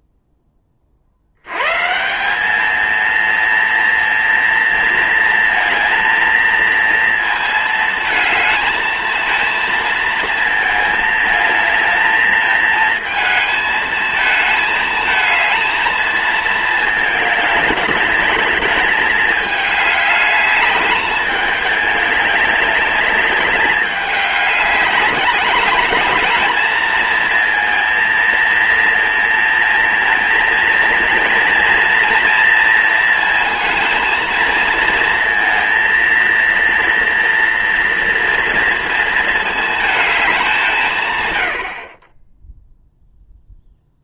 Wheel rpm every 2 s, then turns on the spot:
40, 220, 230, 230, 230, 220, 220, 220, 220, 210, 210, 200, 200, 220, 230, 230, 230, 230, 230, 230, 140, 0.
none